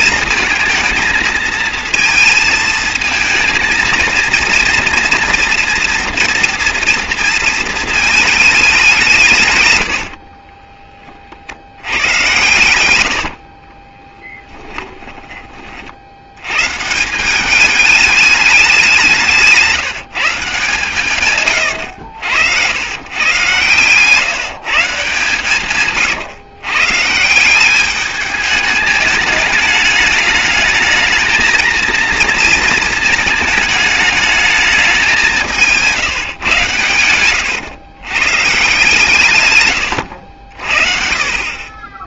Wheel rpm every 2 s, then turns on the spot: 230, 230, 230, 240, 200, 30, 100, 10, 130, 190, 140, 100, 160, 130, 210, 220, 230, 210, 110, 150, 50.
10-16